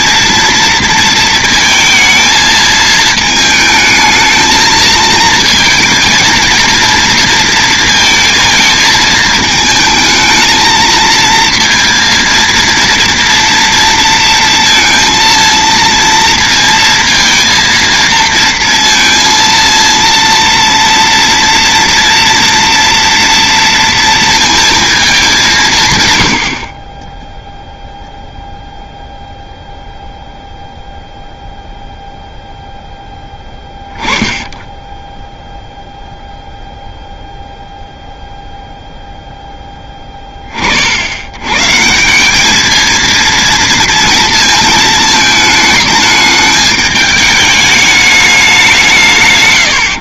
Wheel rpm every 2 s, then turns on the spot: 230, 220, 220, 230, 220, 220, 230, 230, 230, 230, 230, 230, 230, 40, 0, 0, 0, 10, 0, 0, 50, 220, 230, 210, 180.
none